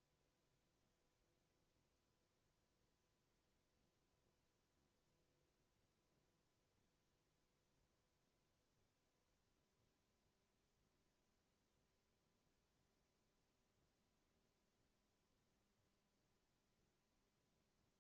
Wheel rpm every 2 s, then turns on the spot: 0, 0, 0, 0, 0, 0, 0, 0, 0.
none